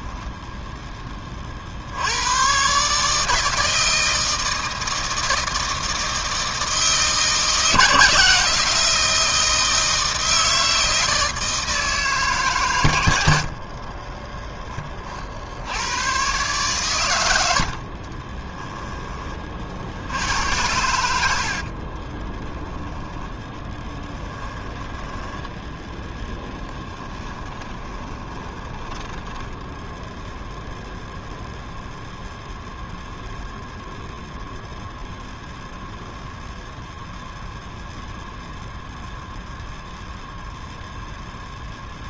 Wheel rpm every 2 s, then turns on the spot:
10, 120, 160, 160, 160, 160, 110, 20, 120, 10, 80, 10, 10, 10, 10, 0, 0, 0, 0, 0, 0.
24-30